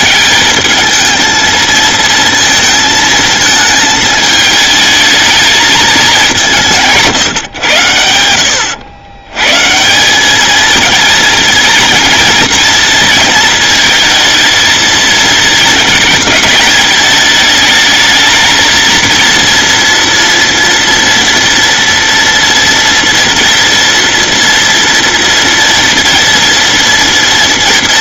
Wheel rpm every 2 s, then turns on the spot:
220, 230, 220, 170, 80, 220, 230, 220, 210, 220, 230, 230, 230, 230.
none